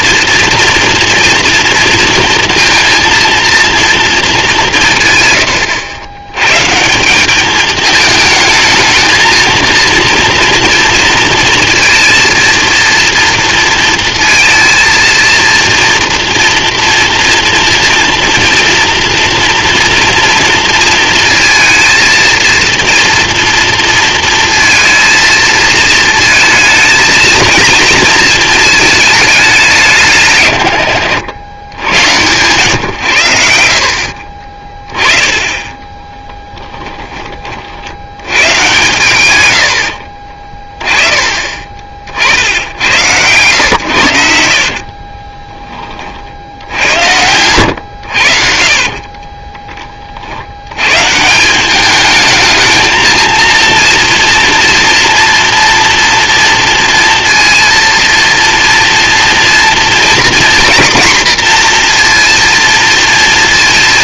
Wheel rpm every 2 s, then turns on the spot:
230, 230, 170, 150, 220, 230, 230, 230, 230, 230, 230, 230, 230, 220, 220, 110, 120, 30, 10, 120, 30, 80, 50, 80, 50, 110, 220, 240, 230, 230, 240, 230.
34-36 40-42 44-46